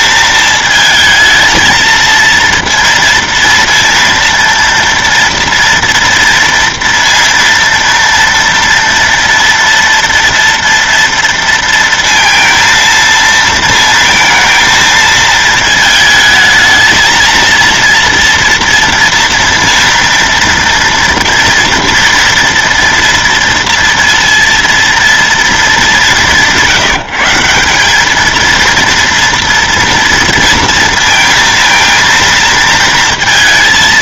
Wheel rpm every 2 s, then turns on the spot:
220, 230, 230, 230, 230, 230, 230, 230, 220, 230, 230, 230, 230, 170, 230, 230, 230.
none